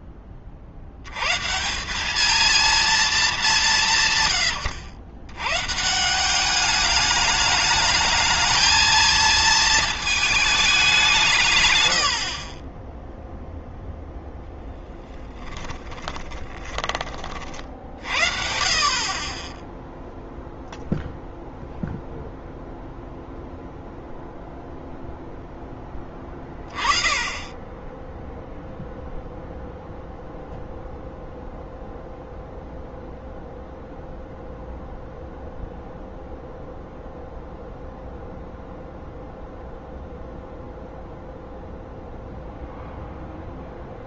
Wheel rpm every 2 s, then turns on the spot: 70, 220, 100, 210, 220, 200, 30, 10, 30, 40, 0, 0, 0, 30, 0, 0, 0, 0, 0, 0, 0, 0.
14-16